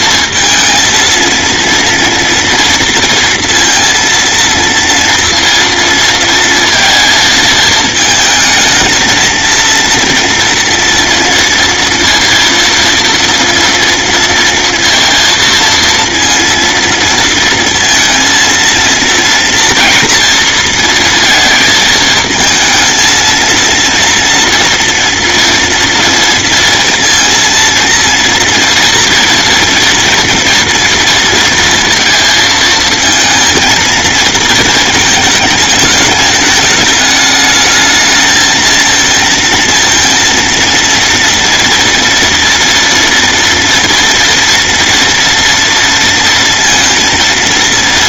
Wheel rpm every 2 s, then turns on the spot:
230, 230, 230, 230, 230, 230, 230, 230, 230, 230, 230, 230, 230, 230, 230, 230, 220, 220, 210, 230, 230, 240, 240, 230.
none